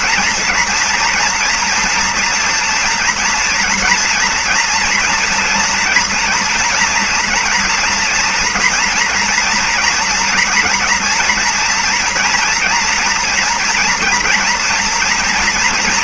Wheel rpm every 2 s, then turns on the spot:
230, 230, 230, 240, 230, 230, 240, 230.
none